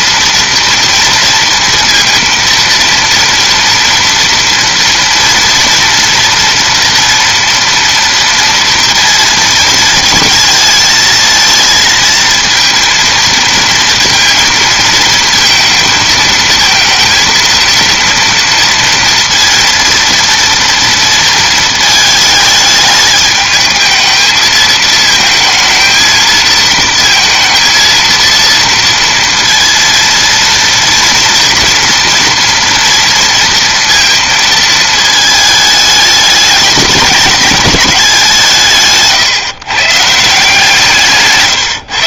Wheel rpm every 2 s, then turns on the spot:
230, 230, 230, 230, 230, 220, 230, 230, 230, 230, 230, 210, 220, 230, 230, 230, 230, 220, 210, 160, 160.
none